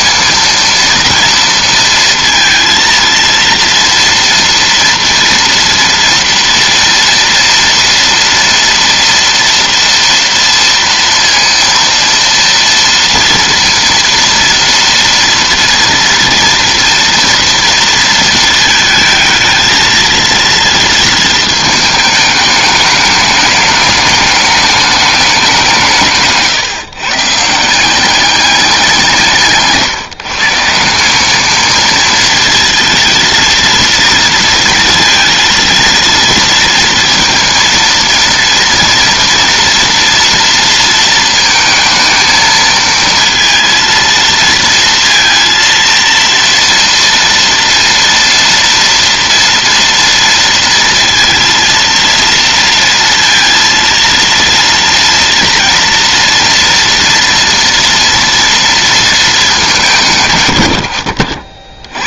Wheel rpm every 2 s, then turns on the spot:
230, 230, 230, 230, 230, 230, 230, 230, 230, 220, 230, 210, 200, 140, 190, 160, 230, 230, 230, 230, 230, 230, 230, 230, 230, 230, 230, 230, 230, 230, 100.
none